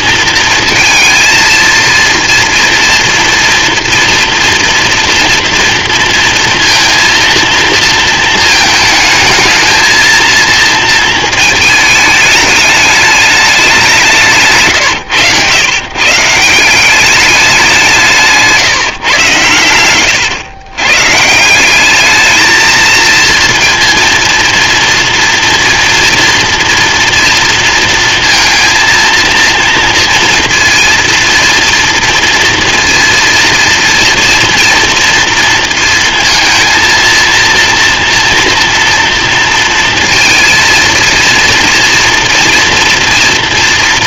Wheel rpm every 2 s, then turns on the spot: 230, 230, 230, 230, 220, 230, 210, 140, 190, 130, 130, 220, 240, 230, 230, 230, 230, 230, 230, 230, 230, 220.
none